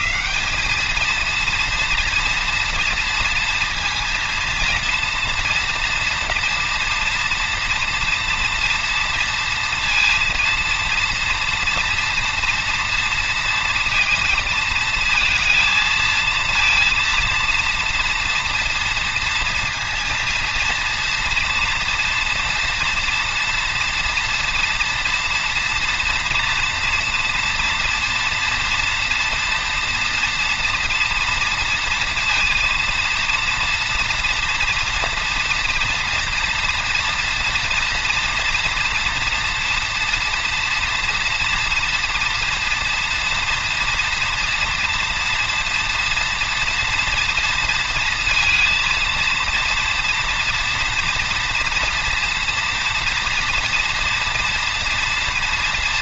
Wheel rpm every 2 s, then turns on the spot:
220, 230, 230, 230, 230, 230, 230, 230, 230, 230, 230, 230, 230, 240, 230, 230, 230, 230, 240, 240, 240, 230, 230, 230, 230, 230, 230, 230.
none